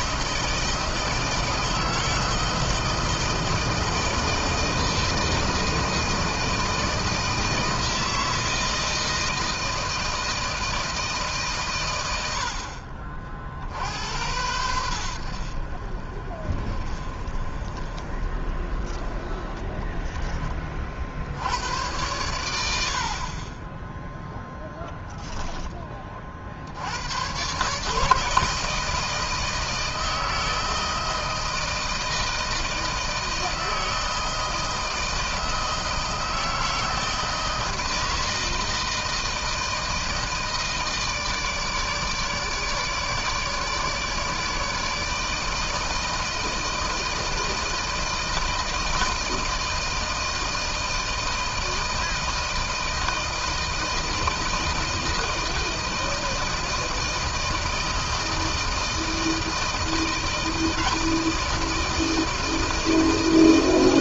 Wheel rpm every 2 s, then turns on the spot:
160, 160, 160, 160, 160, 160, 80, 90, 40, 30, 10, 90, 0, 50, 160, 160, 160, 160, 160, 160, 160, 150, 150, 160, 160, 160, 160, 160, 160, 160, 160, 160.
none